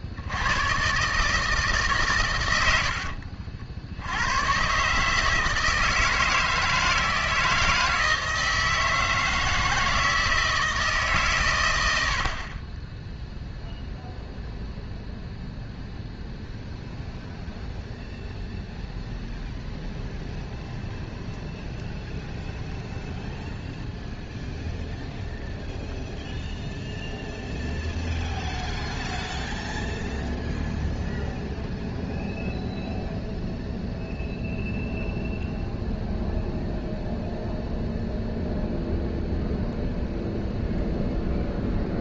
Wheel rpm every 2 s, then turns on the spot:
130, 90, 140, 160, 160, 150, 10, 0, 0, 0, 0, 0, 0, 0, 0, 0, 0, 0, 0, 0, 0.
none